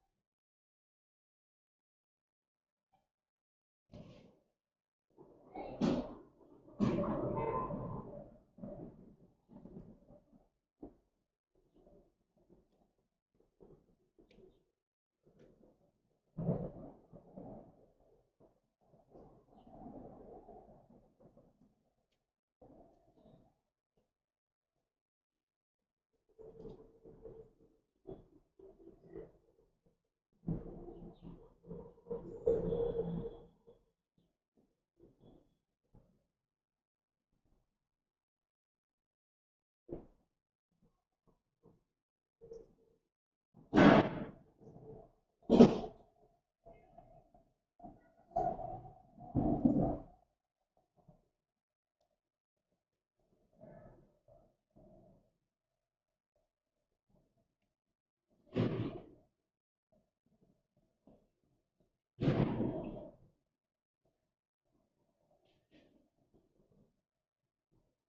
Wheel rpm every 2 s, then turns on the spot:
0, 0, 0, 0, 0, 0, 0, 0, 0, 0, 0, 0, 0, 0, 0, 0, 0, 0, 0, 0, 0, 0, 0, 0, 0, 0, 0, 0, 0, 0, 0, 0, 0, 0.
none